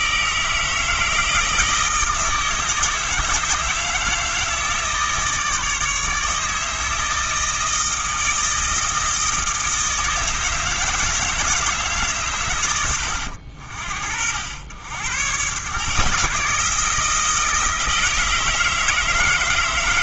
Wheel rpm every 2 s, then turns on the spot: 160, 160, 160, 160, 160, 160, 100, 90, 160, 160.
none